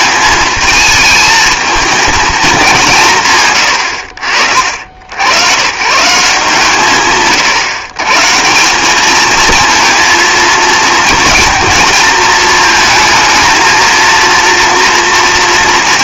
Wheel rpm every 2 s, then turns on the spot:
220, 200, 60, 160, 180, 230, 220, 230.
none